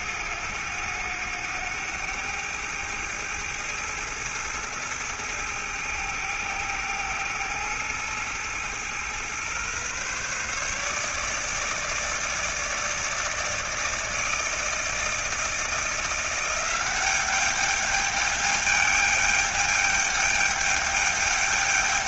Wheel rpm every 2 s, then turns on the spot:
100, 110, 110, 110, 110, 150, 160, 160, 190, 210, 210.
none